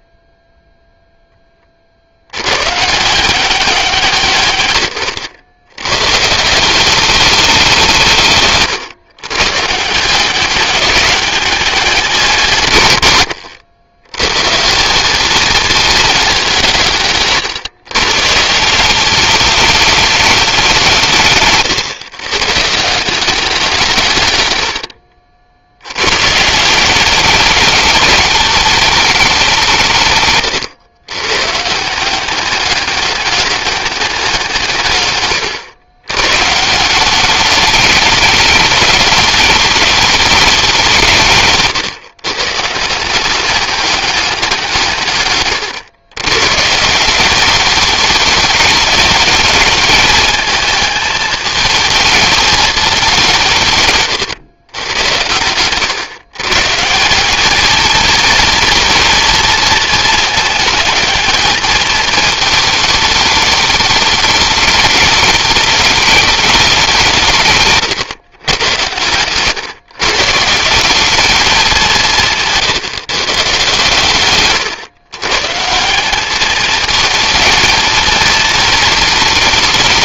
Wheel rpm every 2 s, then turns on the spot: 20, 180, 110, 200, 130, 190, 90, 220, 130, 210, 130, 170, 70, 200, 170, 130, 200, 120, 200, 210, 150, 190, 130, 200, 220, 220, 170, 110, 220, 230, 220, 210, 210, 140, 140, 190, 140, 150, 230, 220.
40-42 44-46